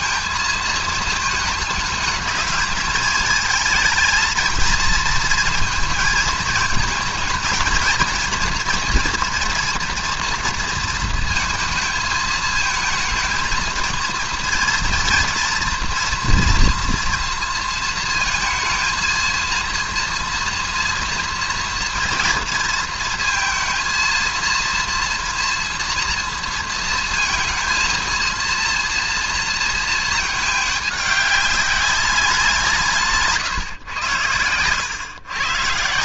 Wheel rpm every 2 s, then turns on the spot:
220, 220, 220, 220, 230, 230, 220, 230, 240, 230, 230, 230, 230, 230, 230, 210, 170, 110.
none